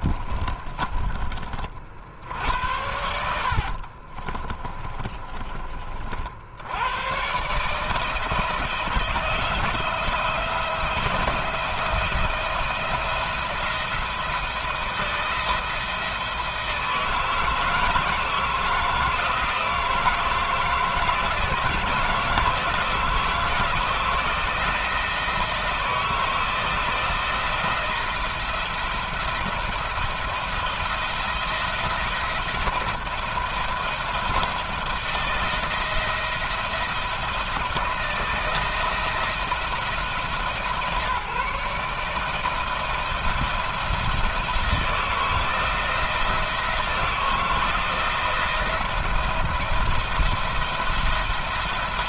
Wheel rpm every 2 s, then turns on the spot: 30, 80, 30, 110, 160, 170, 170, 170, 160, 160, 160, 160, 170, 160, 170, 170, 170, 160, 170, 160, 160, 160, 160, 170, 170, 170.
0-6